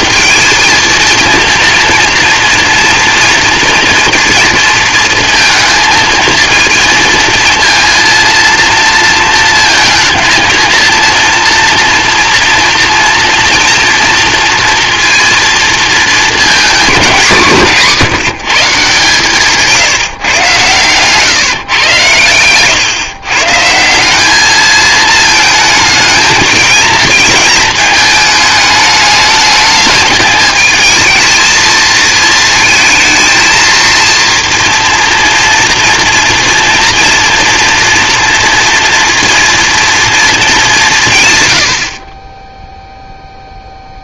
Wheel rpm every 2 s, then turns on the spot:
230, 230, 230, 220, 230, 230, 240, 230, 210, 150, 120, 120, 220, 220, 220, 220, 220, 230, 230, 230, 200, 0.
none